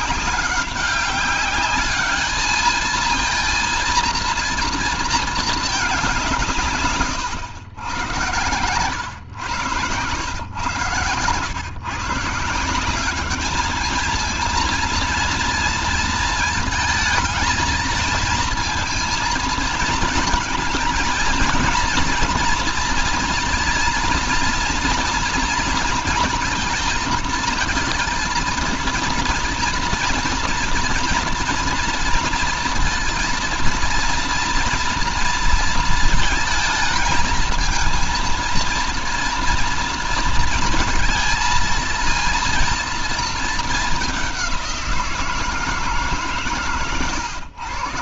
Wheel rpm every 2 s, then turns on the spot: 200, 220, 220, 130, 110, 120, 180, 230, 220, 230, 220, 230, 230, 230, 230, 230, 230, 230, 230, 230, 220, 230, 180, 120.
none